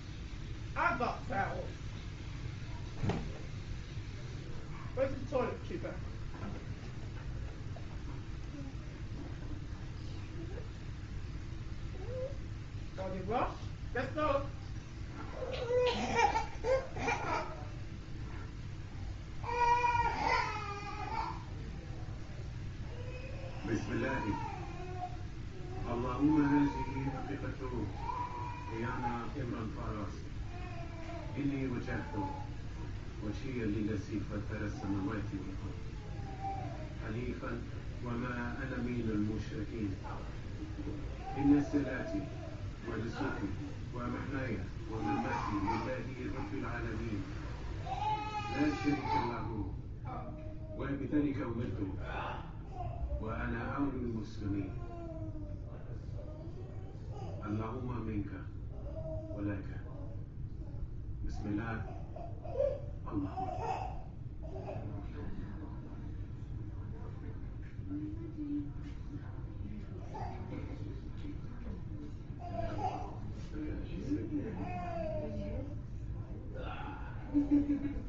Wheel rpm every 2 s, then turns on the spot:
0, 0, 0, 0, 0, 0, 0, 0, 0, 0, 0, 0, 0, 0, 0, 0, 0, 0, 0, 0, 0, 0, 0, 0, 0, 0, 0, 0, 0, 0, 0, 0, 0, 0, 0, 0, 0, 0, 0.
none